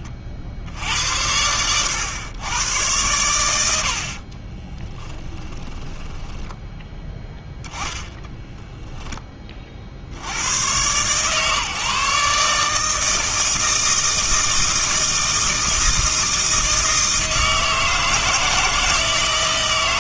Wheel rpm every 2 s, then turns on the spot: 70, 110, 20, 10, 0, 110, 150, 160, 160, 160.
4-6